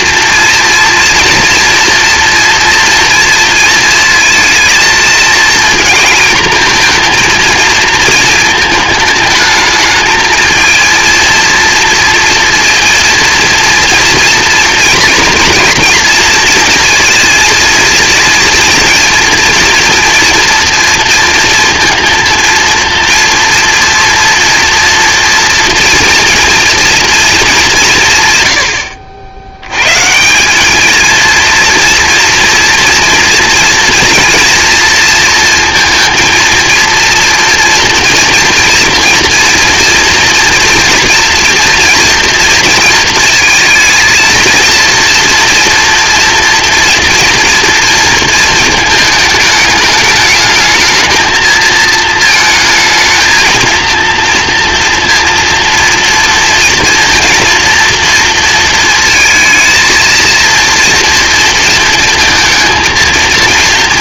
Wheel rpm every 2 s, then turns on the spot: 230, 230, 220, 230, 220, 230, 230, 230, 230, 230, 240, 230, 230, 240, 90, 220, 230, 230, 230, 240, 240, 230, 230, 240, 220, 220, 220, 230, 230, 230, 230, 230.
none